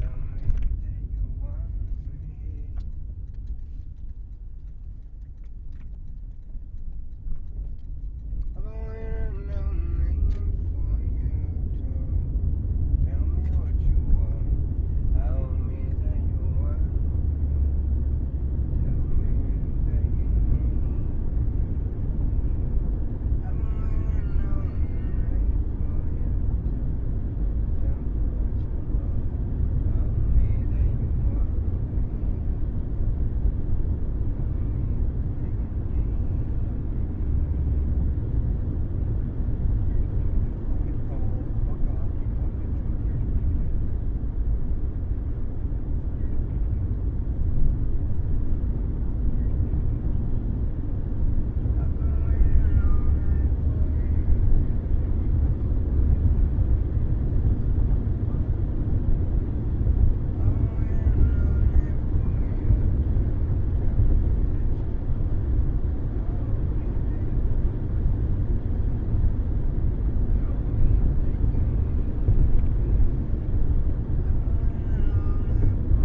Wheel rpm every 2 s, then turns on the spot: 0, 0, 0, 0, 0, 0, 0, 0, 0, 0, 0, 0, 0, 0, 0, 0, 0, 0, 0, 0, 0, 0, 0, 0, 0, 0, 0, 0, 0, 0, 0, 0, 0, 0, 0, 0, 0, 0.
none